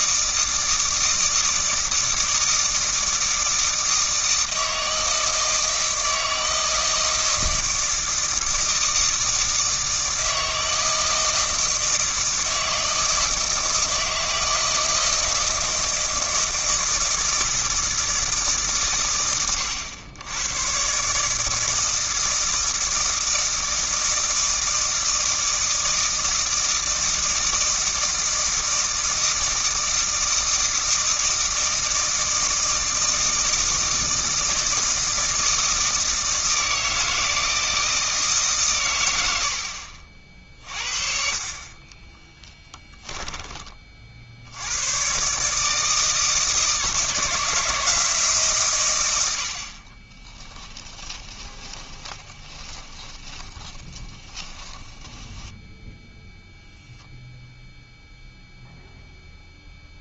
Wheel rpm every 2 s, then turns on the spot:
160, 160, 160, 160, 160, 160, 160, 160, 160, 150, 120, 160, 160, 160, 160, 160, 160, 160, 160, 150, 50, 20, 80, 160, 150, 10, 20, 10, 0, 0.
42-44 50-56